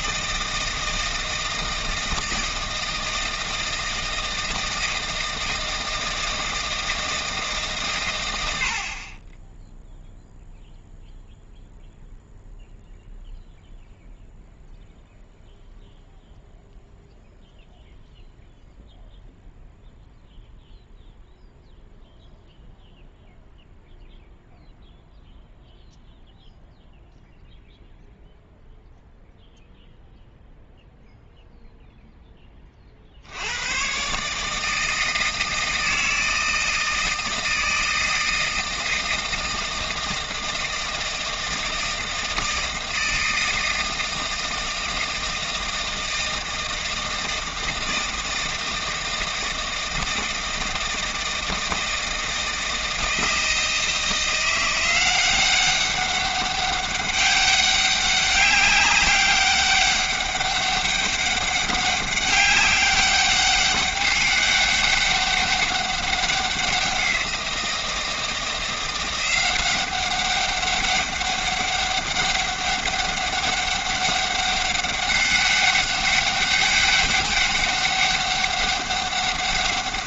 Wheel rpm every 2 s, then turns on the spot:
160, 160, 160, 160, 70, 0, 0, 0, 0, 0, 0, 0, 0, 0, 0, 0, 30, 160, 160, 160, 160, 160, 160, 160, 160, 160, 160, 180, 200, 200, 200, 200, 200, 190, 170, 200, 200, 200, 200, 190.
none